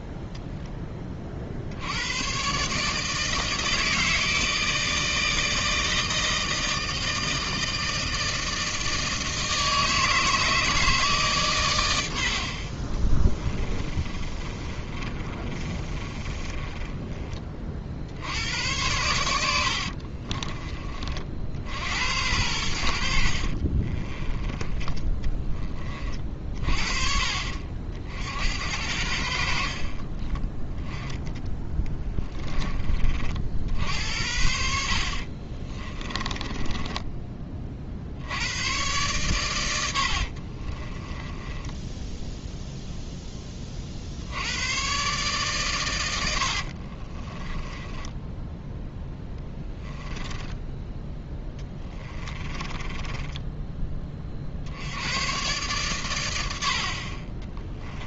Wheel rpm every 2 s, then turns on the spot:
10, 140, 160, 160, 160, 160, 50, 30, 20, 90, 30, 80, 20, 40, 80, 10, 20, 70, 20, 100, 40, 0, 110, 50, 10, 10, 20, 70, 70.
14-18 24-26 36-38 40-42 46-48 50-54